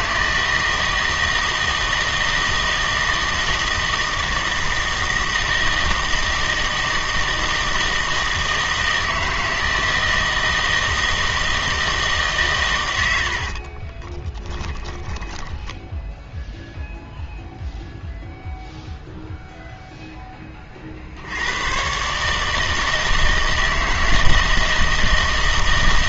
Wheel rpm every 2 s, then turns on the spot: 160, 160, 160, 160, 160, 160, 120, 20, 0, 0, 40, 160, 160.
14-16